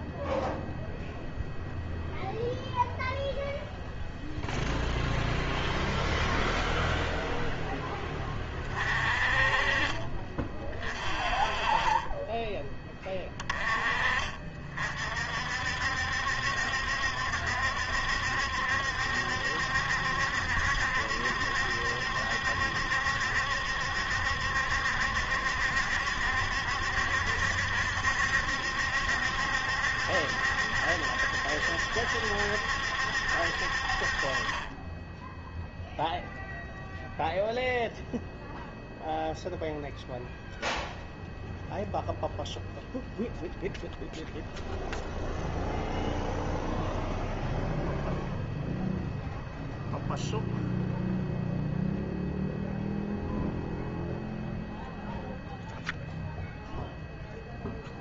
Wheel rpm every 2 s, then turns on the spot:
0, 0, 0, 0, 30, 30, 20, 50, 70, 70, 70, 70, 70, 70, 70, 70, 70, 10, 0, 0, 0, 0, 0, 0, 0, 0, 0, 0, 0.
none